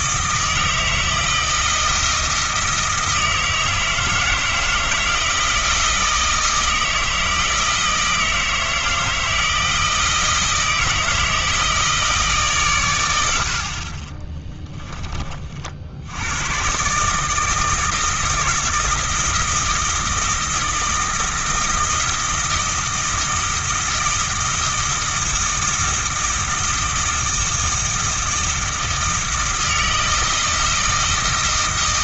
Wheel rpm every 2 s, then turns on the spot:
160, 160, 160, 160, 160, 160, 120, 20, 120, 170, 170, 160, 160, 160, 160, 160.
none